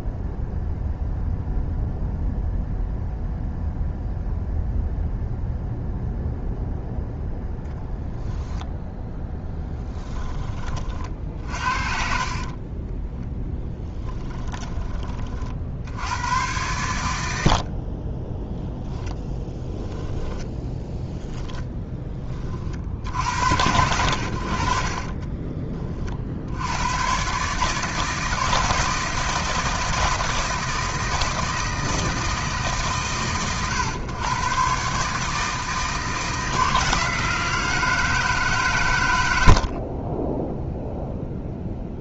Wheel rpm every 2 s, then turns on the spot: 0, 0, 0, 0, 0, 30, 20, 20, 100, 10, 10, 50, 50, 100, 160, 160, 130, 140, 160, 120, 0.
12-14 20-22